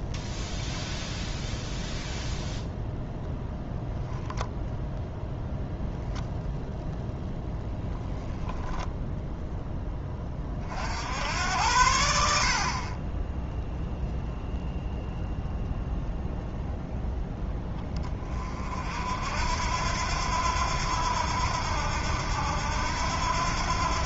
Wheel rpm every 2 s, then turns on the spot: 0, 0, 0, 0, 0, 60, 40, 0, 0, 50, 90, 80.
none